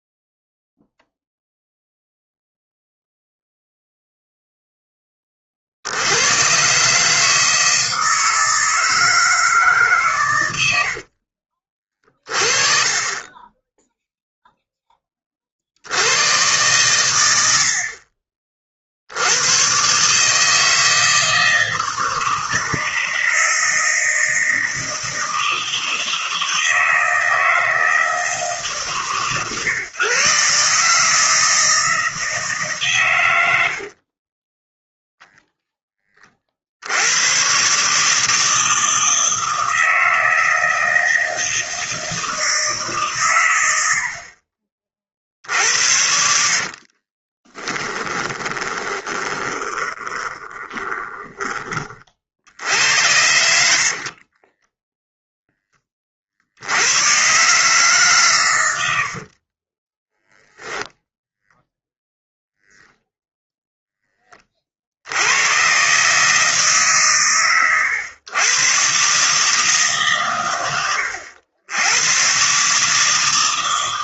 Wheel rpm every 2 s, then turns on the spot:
0, 0, 0, 130, 160, 80, 20, 0, 110, 40, 160, 160, 160, 160, 150, 140, 150, 10, 60, 160, 160, 150, 40, 50, 20, 20, 80, 10, 80, 90, 0, 0, 40, 150, 120, 100, 140.
34-36 46-52 54-56